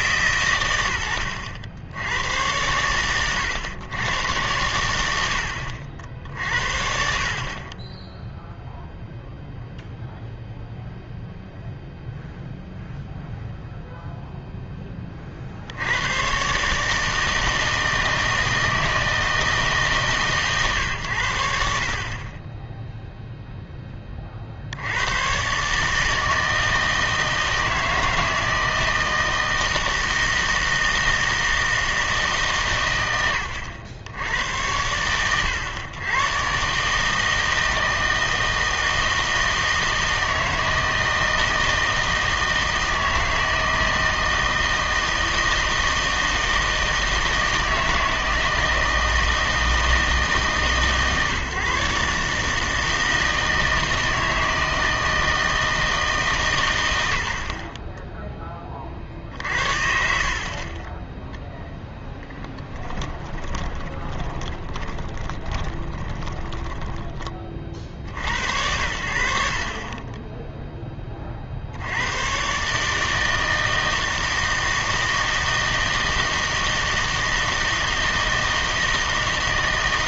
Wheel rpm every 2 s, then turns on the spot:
130, 100, 90, 50, 0, 0, 0, 10, 140, 160, 120, 10, 60, 160, 160, 160, 130, 100, 130, 160, 160, 160, 160, 160, 160, 150, 150, 160, 130, 20, 40, 10, 20, 20, 80, 10, 140, 160, 160, 160.
62-68